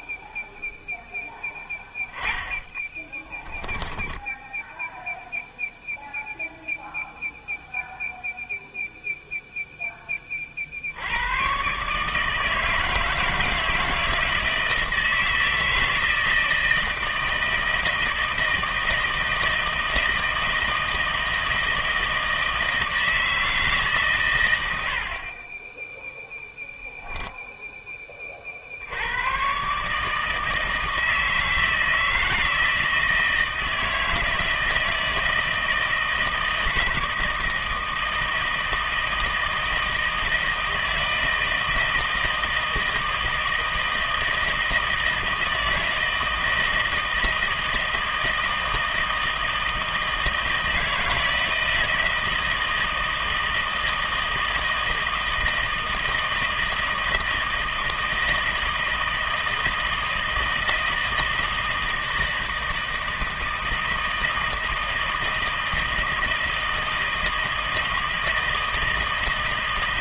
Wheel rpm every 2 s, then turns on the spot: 0, 20, 10, 0, 0, 40, 160, 160, 160, 160, 160, 160, 100, 0, 50, 160, 160, 160, 160, 160, 160, 160, 160, 160, 160, 160, 160, 160, 160, 160, 160, 160, 160, 160, 160.
2-6